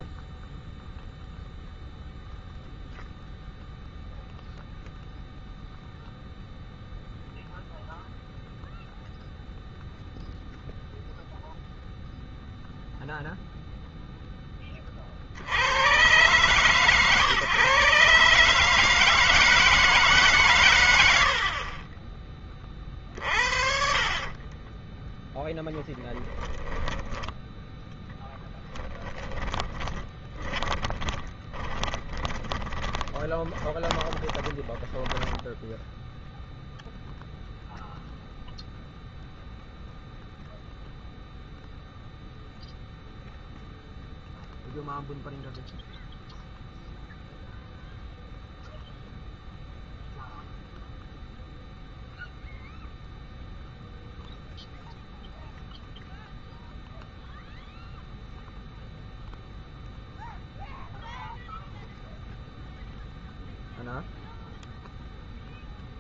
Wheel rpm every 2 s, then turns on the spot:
0, 0, 0, 0, 0, 0, 0, 10, 130, 140, 140, 30, 30, 10, 10, 20, 20, 20, 0, 0, 0, 0, 0, 0, 0, 0, 0, 0, 0, 0, 0, 0, 0.
24-36